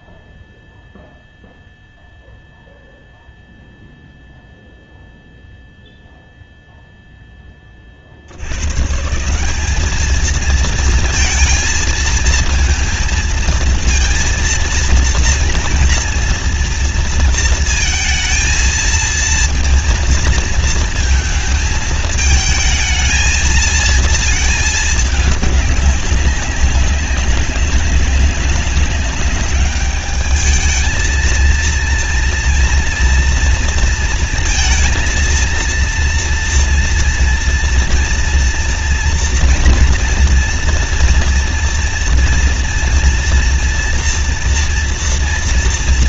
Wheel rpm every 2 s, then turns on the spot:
0, 0, 0, 0, 120, 230, 230, 230, 230, 230, 220, 220, 220, 190, 200, 220, 240, 230, 230, 230, 230, 230, 230.
none